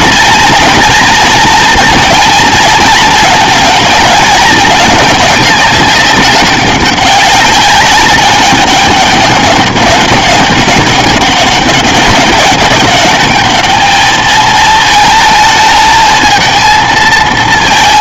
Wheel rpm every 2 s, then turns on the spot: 230, 230, 210, 200, 200, 190, 190, 220, 220.
none